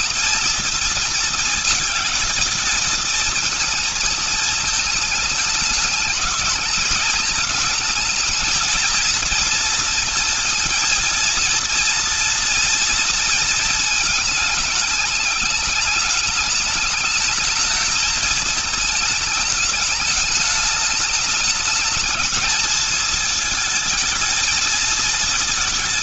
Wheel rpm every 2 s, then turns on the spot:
230, 220, 220, 210, 220, 230, 230, 220, 210, 220, 210, 220, 230.
none